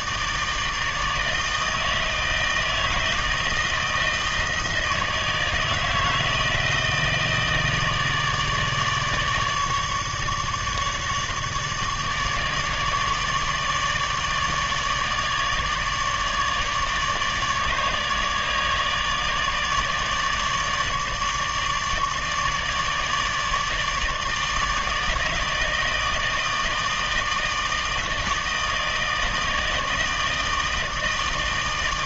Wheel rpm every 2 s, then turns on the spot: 160, 160, 160, 160, 150, 150, 150, 150, 150, 150, 150, 150, 160, 160, 160, 160.
none